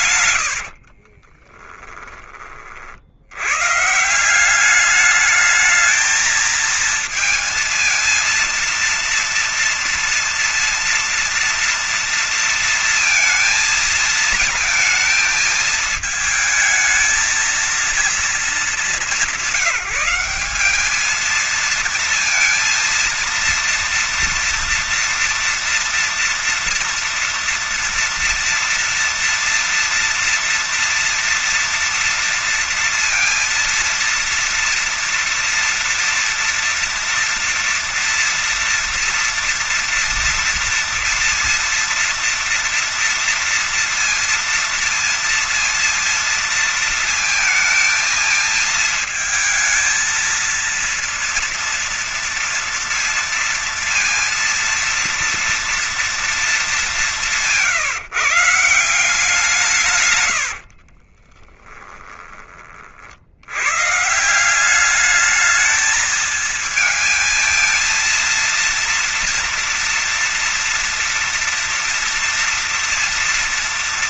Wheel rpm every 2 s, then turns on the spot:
100, 40, 180, 220, 230, 230, 230, 220, 220, 210, 190, 230, 230, 230, 230, 230, 230, 230, 230, 230, 230, 230, 230, 230, 220, 230, 230, 230, 220, 160, 90, 30, 180, 220, 230, 230, 230.
0-2 60-62